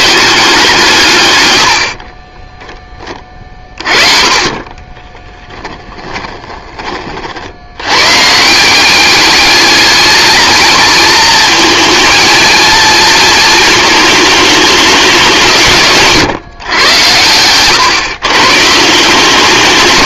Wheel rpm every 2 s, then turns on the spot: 130, 30, 20, 40, 200, 230, 230, 200, 110, 160.
4-6